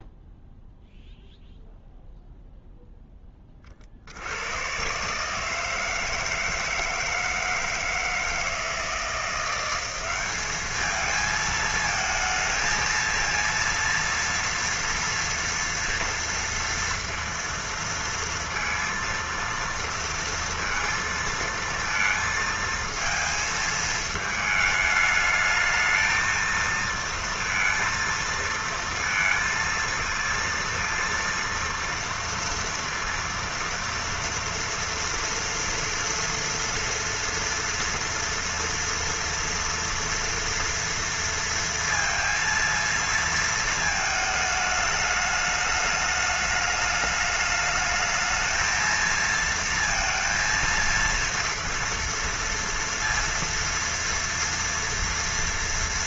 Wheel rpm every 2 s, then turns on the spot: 0, 0, 110, 160, 160, 210, 230, 230, 230, 230, 230, 220, 210, 230, 230, 230, 230, 230, 240, 230, 230, 230, 220, 210, 230, 230, 230, 230.
none